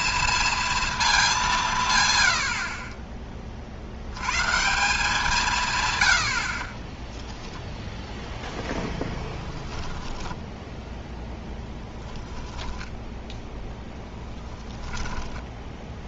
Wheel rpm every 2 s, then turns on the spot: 230, 60, 150, 40, 0, 10, 10, 20.
10-16